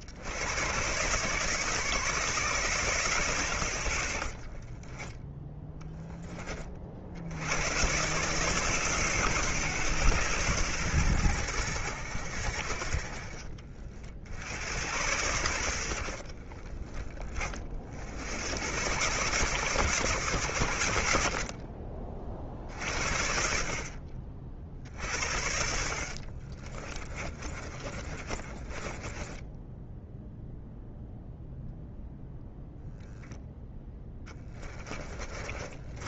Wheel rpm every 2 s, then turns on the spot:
120, 140, 20, 50, 150, 110, 50, 90, 30, 100, 80, 50, 60, 40, 20, 0, 0, 20.
4-6 26-30 34-36